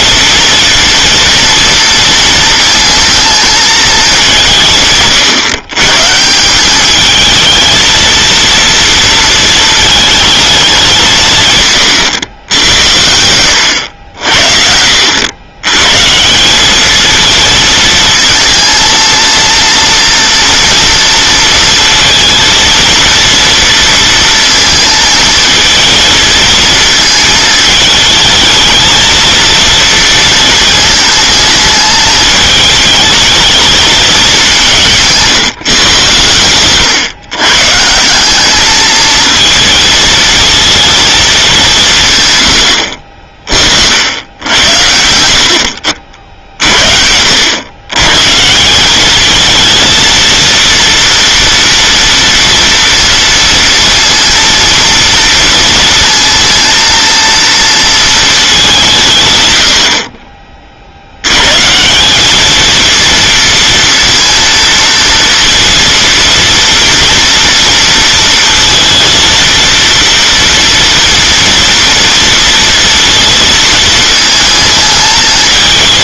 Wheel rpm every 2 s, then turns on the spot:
230, 230, 150, 200, 230, 190, 80, 70, 210, 220, 230, 230, 230, 220, 220, 230, 210, 170, 120, 220, 230, 80, 80, 60, 180, 230, 230, 230, 230, 180, 50, 230, 230, 230, 230, 230, 230, 220.
none